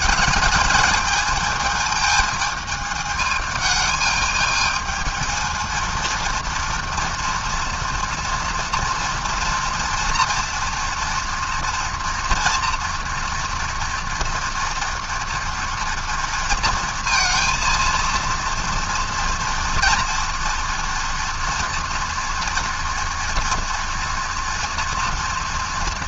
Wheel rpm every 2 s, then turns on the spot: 220, 220, 220, 230, 230, 230, 230, 230, 230, 230, 230, 230, 230.
none